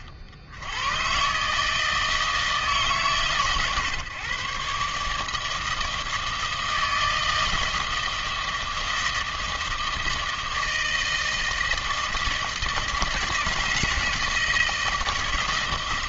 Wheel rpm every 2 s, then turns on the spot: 60, 160, 140, 160, 160, 160, 160, 160.
none